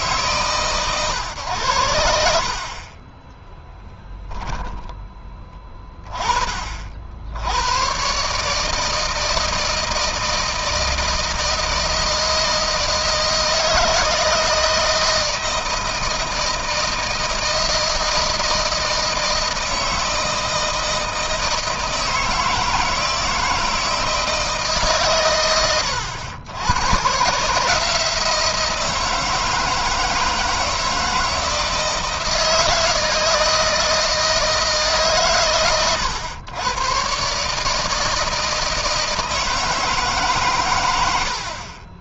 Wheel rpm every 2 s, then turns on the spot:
120, 40, 10, 50, 160, 160, 160, 160, 170, 160, 160, 160, 140, 110, 170, 160, 160, 150, 120, 160, 90.
2-4